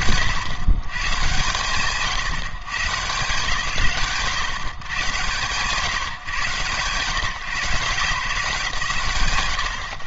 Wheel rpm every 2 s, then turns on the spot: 100, 130, 110, 150, 130.
none